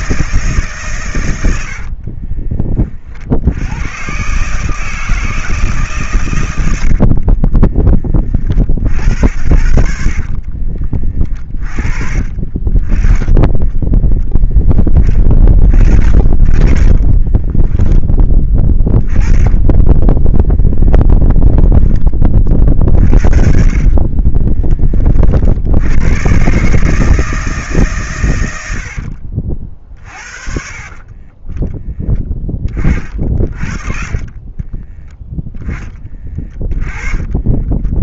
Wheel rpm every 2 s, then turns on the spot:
150, 40, 150, 90, 40, 30, 30, 10, 30, 20, 0, 40, 30, 140, 90, 40, 30, 30, 20.
6-8 10-12 16-20 24-26 32-38